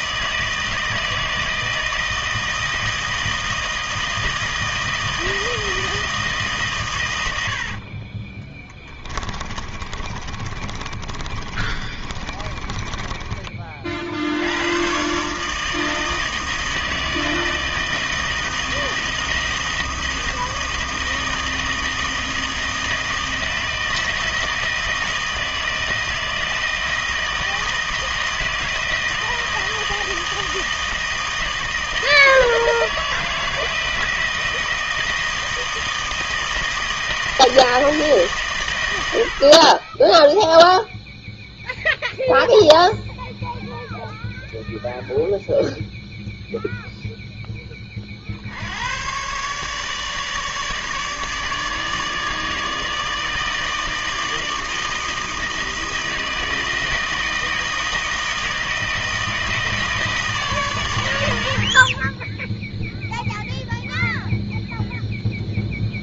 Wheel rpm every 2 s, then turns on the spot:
160, 160, 160, 140, 20, 30, 20, 100, 160, 160, 160, 160, 160, 160, 160, 160, 160, 160, 160, 120, 0, 0, 0, 0, 70, 150, 160, 160, 160, 160, 140, 10, 0.
8-14